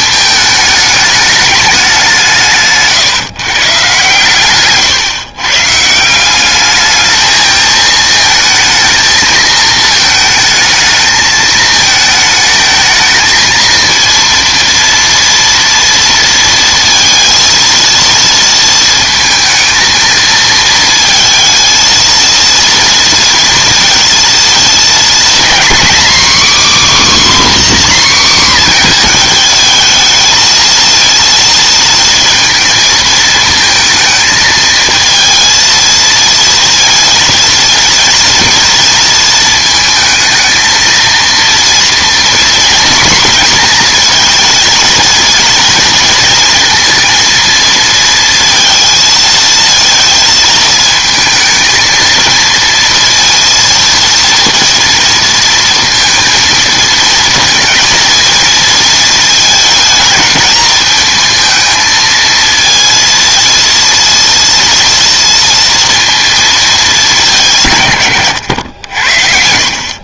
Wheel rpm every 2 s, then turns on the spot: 210, 140, 120, 210, 220, 220, 220, 230, 230, 230, 220, 230, 230, 280, 250, 230, 230, 220, 230, 230, 220, 240, 230, 230, 230, 220, 230, 230, 220, 230, 220, 230, 230, 210, 90.
4-6